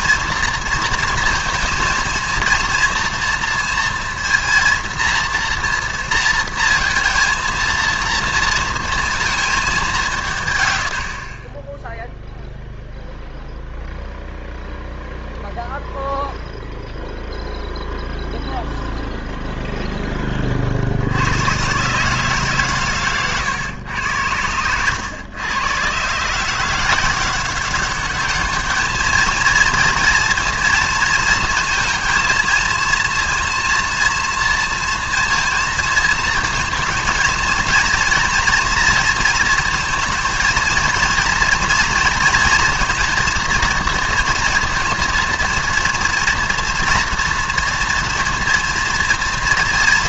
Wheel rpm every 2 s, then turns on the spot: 230, 230, 230, 230, 230, 120, 0, 0, 0, 0, 50, 140, 100, 160, 210, 230, 220, 230, 230, 230, 230, 240, 230, 230, 230.
none